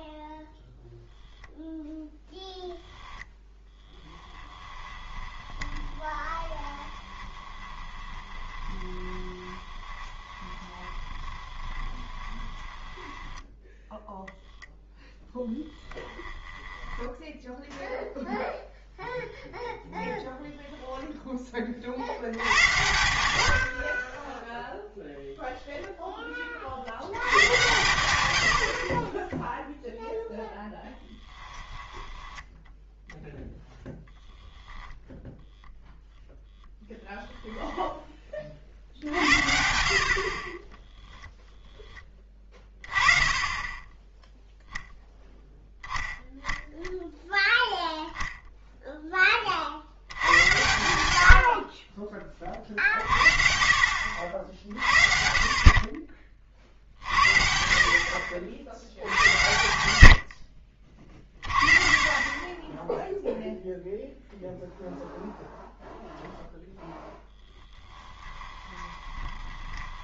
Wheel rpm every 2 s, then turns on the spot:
0, 0, 20, 20, 20, 20, 10, 0, 10, 0, 0, 80, 0, 50, 60, 0, 10, 0, 0, 60, 10, 20, 0, 0, 10, 90, 50, 60, 50, 70, 30, 0, 0, 0, 20.
4-14 16-18 68-70